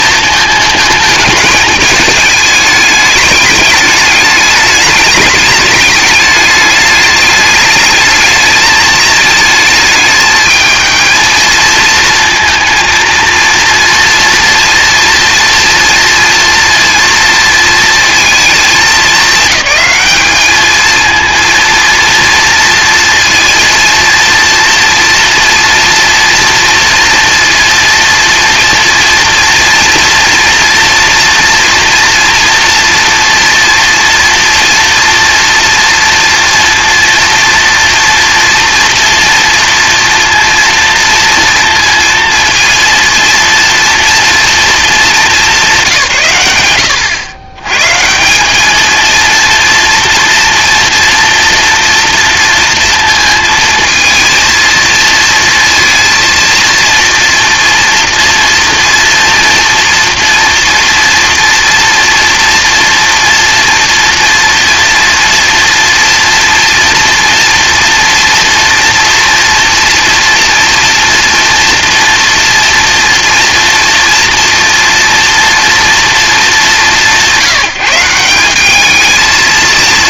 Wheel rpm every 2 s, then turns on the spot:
220, 210, 210, 210, 210, 220, 230, 240, 230, 210, 210, 230, 230, 230, 230, 230, 230, 230, 230, 230, 230, 230, 230, 120, 200, 230, 230, 230, 230, 230, 230, 230, 230, 240, 230, 240, 230, 230, 210, 190.
none